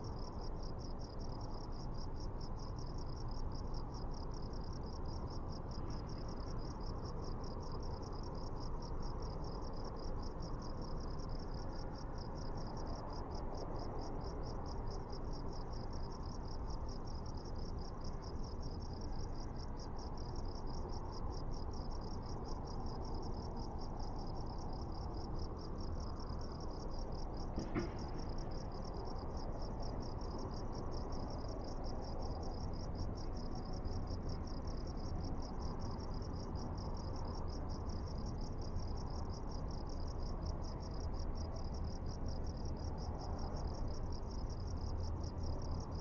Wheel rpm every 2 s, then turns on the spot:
0, 0, 0, 0, 0, 0, 0, 0, 0, 0, 0, 0, 0, 0, 0, 0, 0, 0, 0, 0, 0, 0, 0.
none